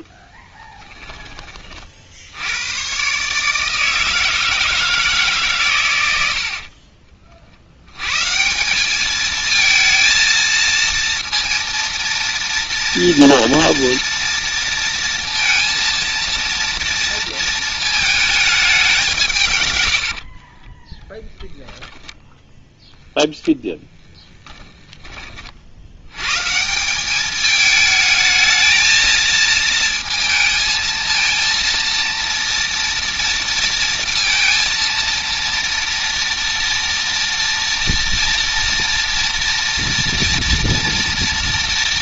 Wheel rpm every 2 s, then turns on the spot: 10, 110, 160, 50, 200, 230, 230, 230, 230, 200, 20, 0, 20, 180, 220, 230, 230, 230, 230, 230, 240.
0-2 6-8 20-22 24-26